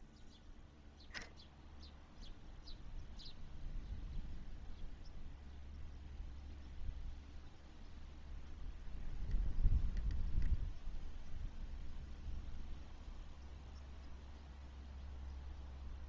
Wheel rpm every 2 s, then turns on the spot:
0, 0, 0, 0, 0, 0, 0, 0.
none